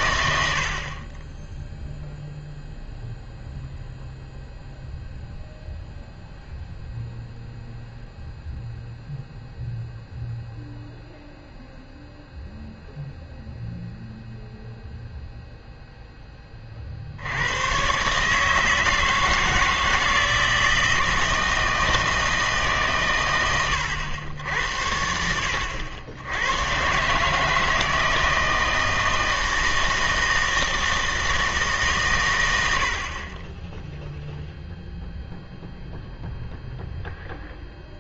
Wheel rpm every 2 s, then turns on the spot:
60, 0, 0, 0, 0, 0, 0, 0, 20, 160, 160, 150, 80, 110, 160, 160, 80, 0, 0.
none